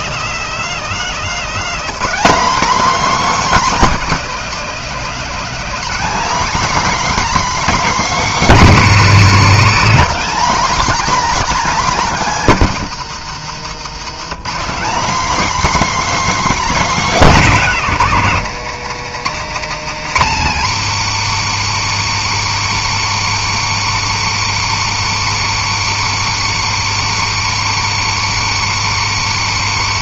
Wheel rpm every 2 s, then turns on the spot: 240, 280, 240, 280, 250, 280, 200, 250, 230, 150, 140, 150, 150, 150, 150.
none